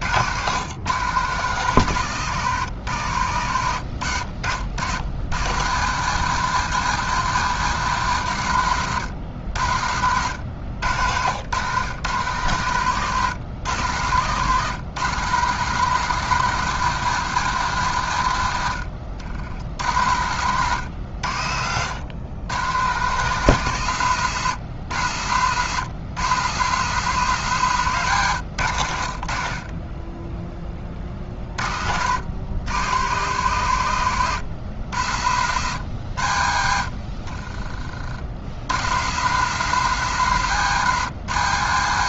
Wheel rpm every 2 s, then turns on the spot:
130, 100, 50, 140, 110, 80, 120, 130, 160, 90, 110, 110, 100, 130, 90, 20, 110, 90, 60, 90, 130.
20-22